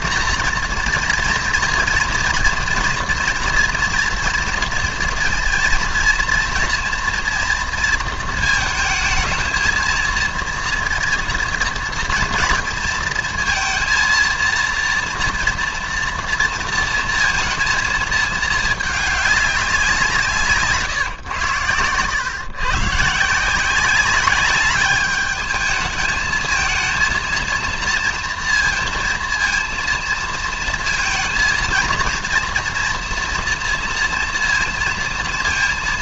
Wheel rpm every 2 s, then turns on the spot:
230, 230, 230, 230, 220, 230, 220, 230, 230, 220, 150, 120, 200, 220, 230, 230, 230, 230.
none